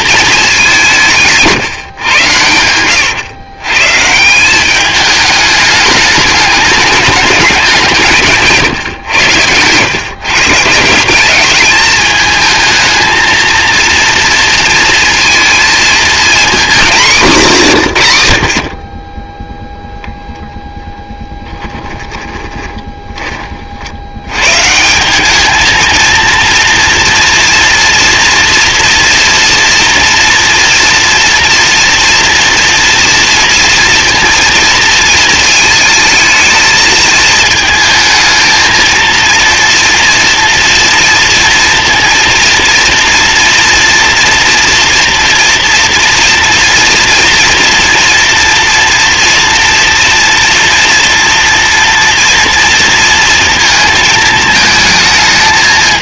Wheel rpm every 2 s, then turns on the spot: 220, 120, 170, 210, 160, 130, 220, 230, 230, 120, 0, 10, 150, 230, 230, 230, 240, 230, 220, 220, 230, 240, 240, 230, 230, 240, 230, 220.
22-24